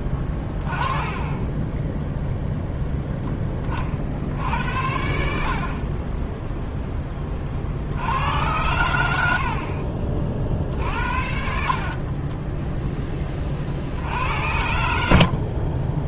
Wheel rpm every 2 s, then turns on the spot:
20, 0, 70, 0, 100, 40, 10, 80.
12-14